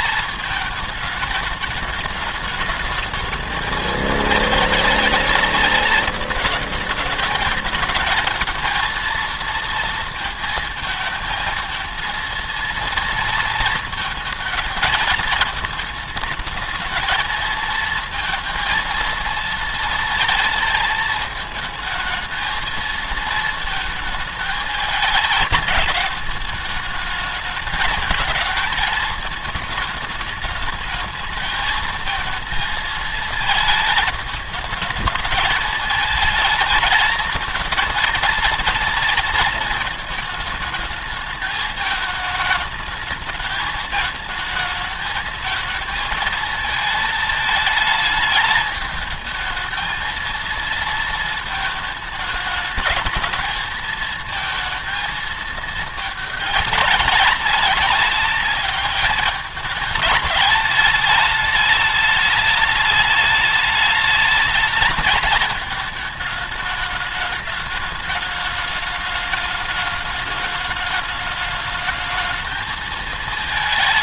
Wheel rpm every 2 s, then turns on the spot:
220, 210, 220, 220, 230, 230, 230, 220, 210, 220, 230, 220, 220, 210, 220, 210, 220, 210, 220, 230, 220, 220, 210, 220, 210, 230, 210, 220, 210, 200, 220, 210, 210, 210, 210, 210, 220.
none